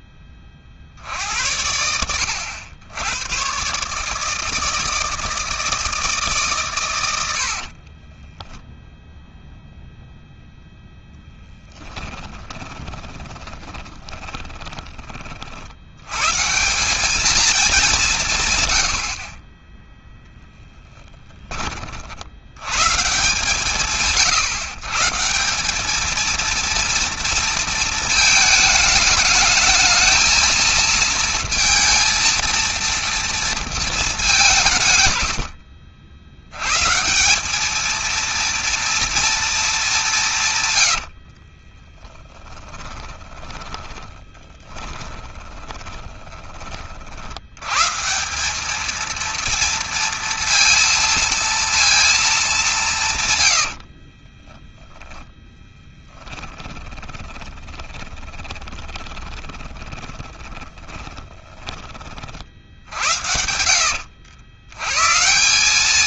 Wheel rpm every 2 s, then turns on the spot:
50, 100, 160, 100, 0, 0, 20, 30, 210, 50, 10, 140, 150, 230, 220, 230, 230, 130, 160, 230, 60, 20, 20, 50, 220, 230, 150, 20, 20, 20, 30, 70, 120.
12-14 20-22 34-36 40-46 52-54 56-62